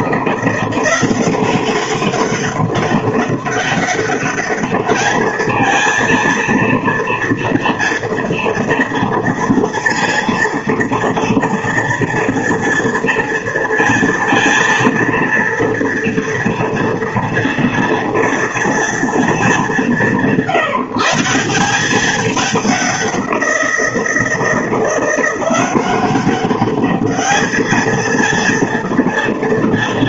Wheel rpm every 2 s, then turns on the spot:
180, 200, 210, 230, 230, 230, 230, 230, 230, 230, 160, 190, 170, 210, 230.
none